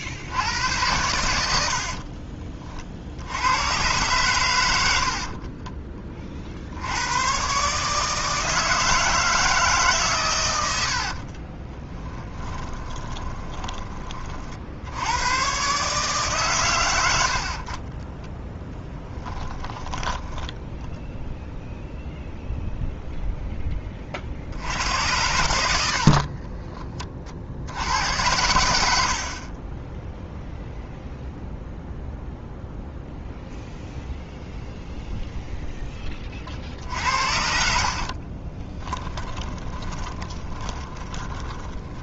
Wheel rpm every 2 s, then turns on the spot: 100, 50, 90, 70, 160, 80, 20, 50, 100, 20, 10, 0, 90, 40, 80, 0, 0, 0, 50, 20, 20.
10-14 18-22 28-30 38-42